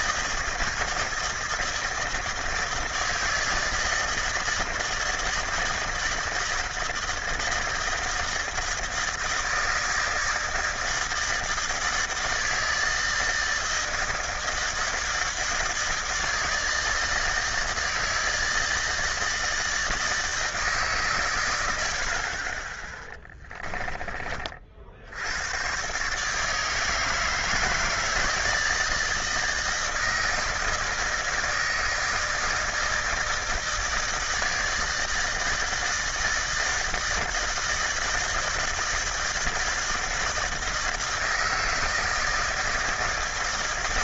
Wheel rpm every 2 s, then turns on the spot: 160, 160, 160, 160, 160, 160, 160, 160, 160, 160, 150, 30, 40, 150, 160, 160, 160, 160, 160, 160, 160, 160.
none